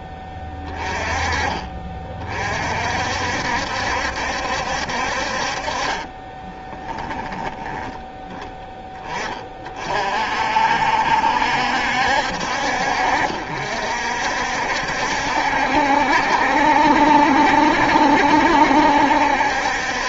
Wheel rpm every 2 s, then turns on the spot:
20, 50, 60, 20, 20, 60, 60, 60, 70, 70.
6-8